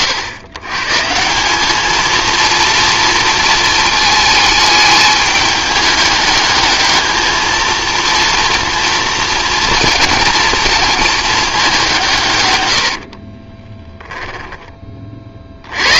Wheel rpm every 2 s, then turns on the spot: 130, 230, 210, 210, 230, 230, 90, 20.
12-14